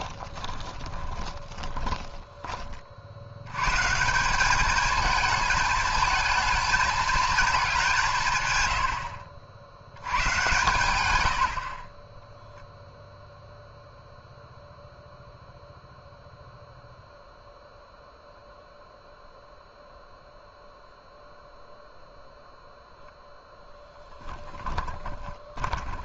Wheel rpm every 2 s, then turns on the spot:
20, 30, 210, 220, 90, 100, 0, 0, 0, 0, 0, 0, 20.
0-2 24-26